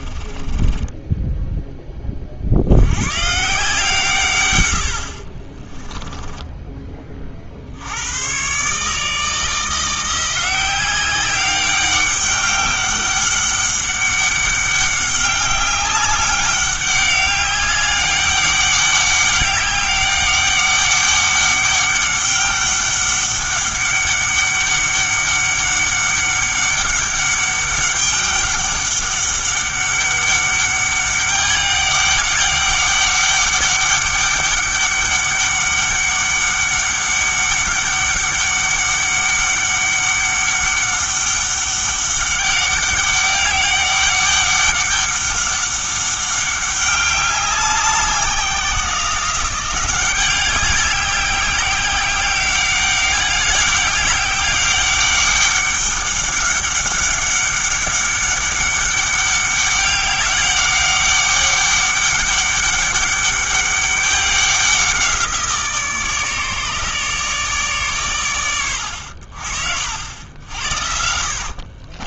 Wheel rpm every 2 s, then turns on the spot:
20, 70, 100, 20, 140, 190, 200, 200, 200, 200, 200, 200, 200, 200, 200, 200, 200, 200, 200, 200, 200, 200, 200, 200, 180, 190, 200, 190, 200, 200, 200, 200, 190, 150, 100, 70.
0-2 4-8